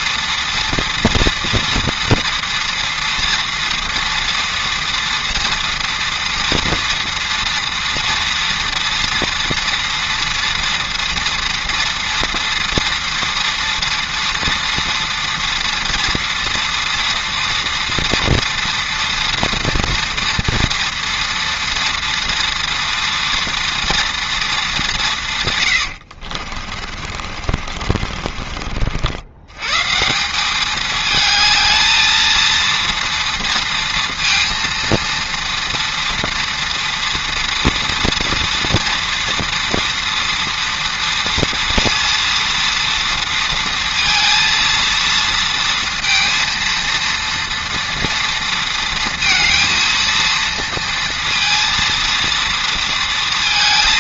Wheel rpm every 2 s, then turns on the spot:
230, 240, 230, 230, 230, 230, 230, 230, 230, 230, 230, 230, 210, 40, 40, 210, 230, 230, 230, 230, 230, 230, 230, 230, 230, 230, 230.
26-28